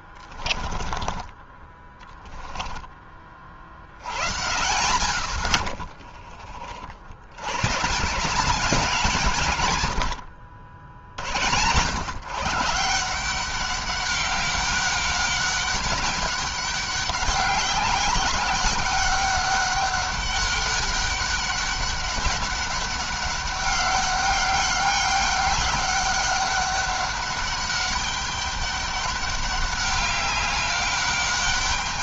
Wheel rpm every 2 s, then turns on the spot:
20, 30, 90, 60, 180, 80, 160, 200, 190, 200, 200, 200, 190, 200, 200, 200.
4-6